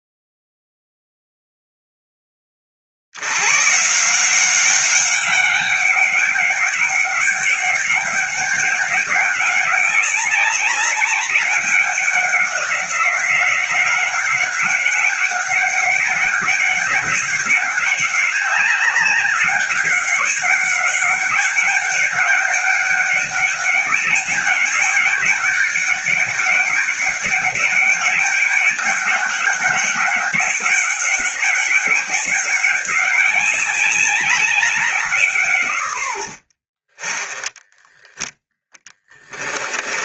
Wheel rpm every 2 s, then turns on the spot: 0, 70, 190, 200, 200, 190, 190, 190, 200, 200, 200, 200, 200, 200, 200, 200, 200, 170, 30, 20.
38-40